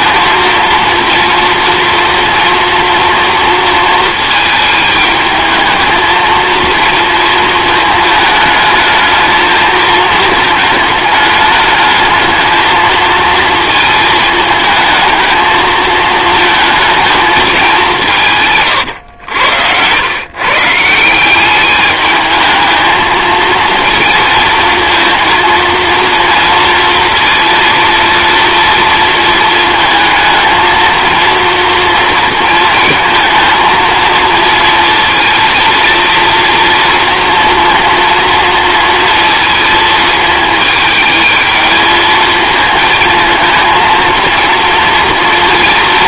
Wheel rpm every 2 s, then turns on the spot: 230, 230, 220, 230, 220, 220, 220, 220, 220, 130, 160, 220, 230, 230, 230, 230, 220, 230, 230, 230, 220, 220, 230.
18-20